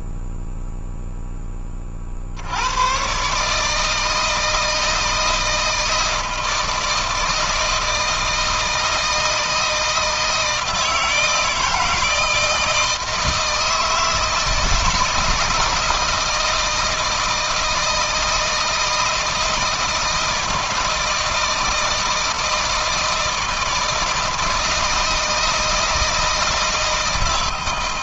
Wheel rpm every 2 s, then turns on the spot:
0, 60, 160, 160, 160, 160, 160, 160, 160, 160, 160, 160, 160, 160.
none